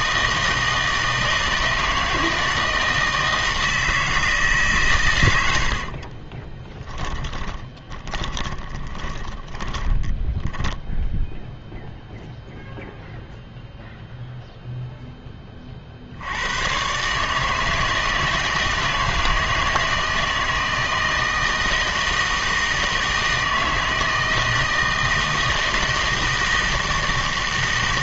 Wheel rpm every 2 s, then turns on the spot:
160, 160, 150, 10, 20, 10, 0, 0, 120, 160, 160, 160, 160, 160.
6-12